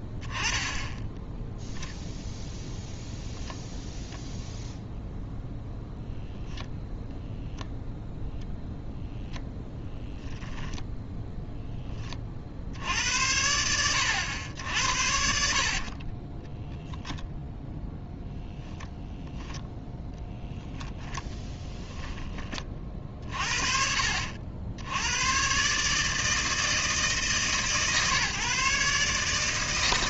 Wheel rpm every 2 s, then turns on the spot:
10, 0, 0, 10, 0, 0, 80, 60, 0, 0, 10, 40, 90, 160, 140.
none